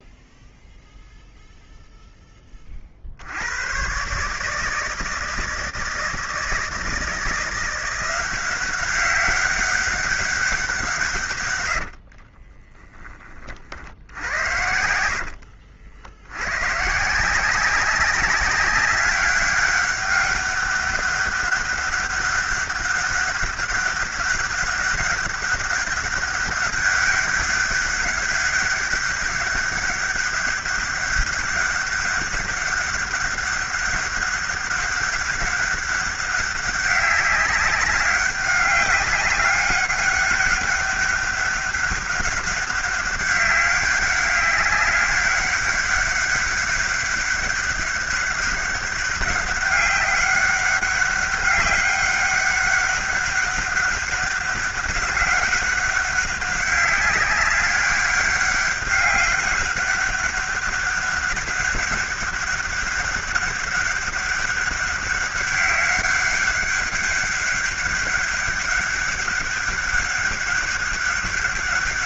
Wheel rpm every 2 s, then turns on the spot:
0, 60, 160, 160, 190, 150, 30, 80, 150, 190, 200, 200, 200, 200, 200, 200, 200, 200, 190, 200, 200, 200, 200, 200, 200, 200, 200, 190, 190, 200, 200, 200, 200, 200, 200, 200.
14-16